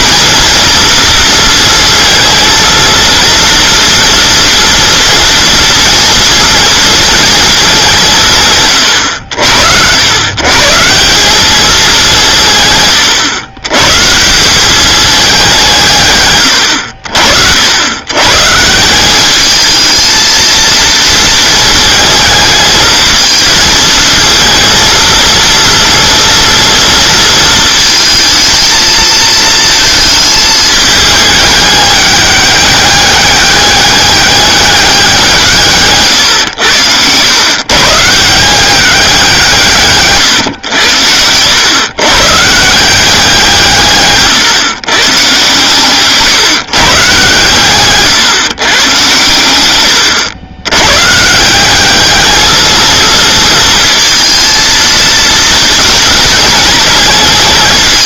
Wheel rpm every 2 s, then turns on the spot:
230, 230, 230, 230, 90, 180, 130, 210, 80, 180, 230, 220, 230, 230, 220, 210, 200, 190, 100, 190, 100, 180, 130, 140, 130, 120, 230, 230, 220.
none